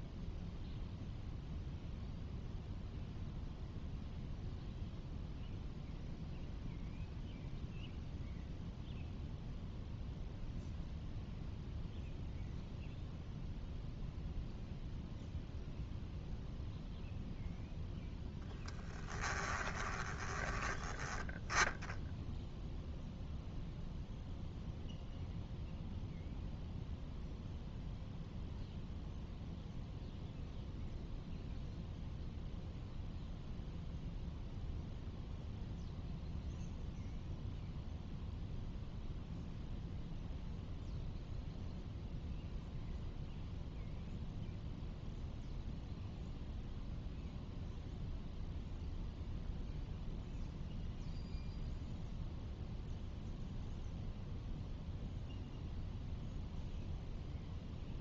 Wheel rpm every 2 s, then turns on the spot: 0, 0, 0, 0, 0, 0, 0, 0, 0, 20, 10, 0, 0, 0, 0, 0, 0, 0, 0, 0, 0, 0, 0, 0, 0, 0, 0, 0, 0.
18-20